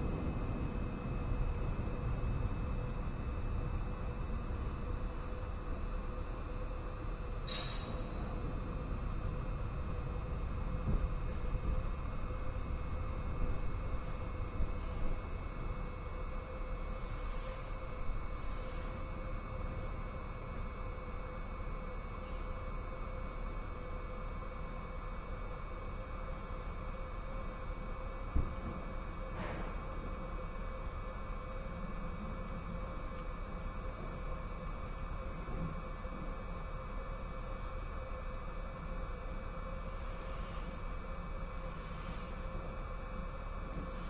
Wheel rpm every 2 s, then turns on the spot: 0, 0, 0, 0, 0, 0, 0, 0, 0, 0, 0, 0, 0, 0, 0, 0, 0, 0, 0, 0, 0, 0.
none